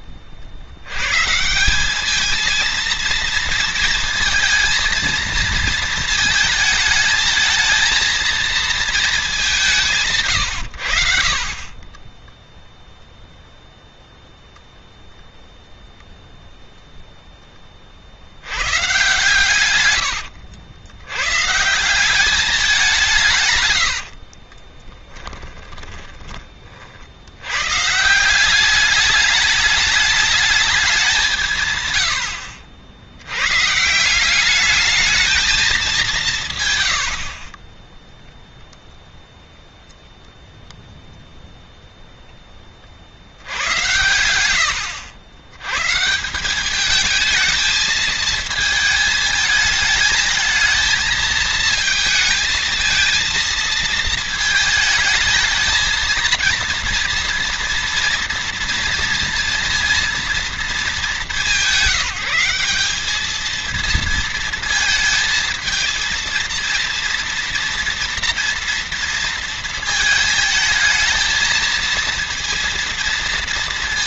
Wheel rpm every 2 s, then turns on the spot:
70, 230, 230, 220, 220, 100, 0, 0, 0, 120, 90, 180, 20, 50, 200, 200, 70, 210, 100, 0, 0, 40, 100, 210, 220, 220, 230, 220, 230, 230, 210, 200, 230, 230, 230, 220, 230.
24-26